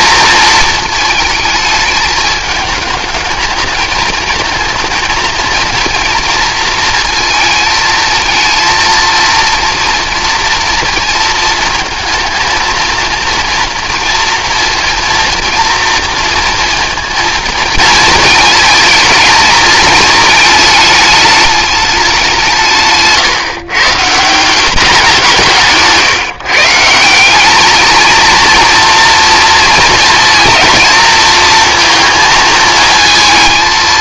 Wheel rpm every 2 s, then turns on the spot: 220, 220, 220, 230, 230, 230, 230, 230, 230, 230, 210, 160, 180, 150, 230, 230, 220.
none